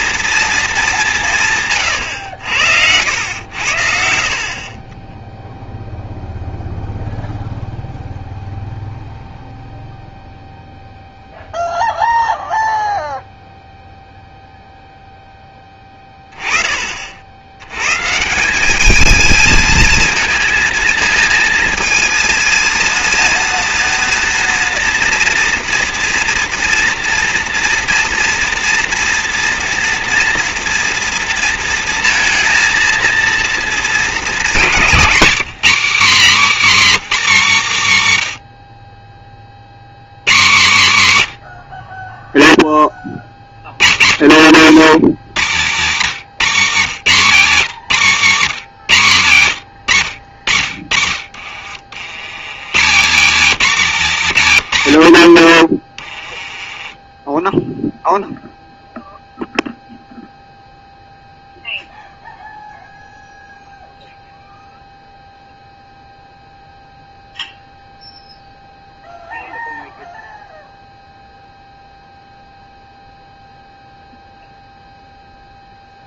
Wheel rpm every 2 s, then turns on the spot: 220, 90, 40, 0, 0, 0, 0, 0, 20, 180, 220, 230, 240, 230, 230, 230, 230, 210, 260, 80, 150, 10, 100, 170, 170, 70, 140, 140, 20, 0, 0, 0, 0, 0, 0, 0, 0, 0.
4-6 36-38 56-58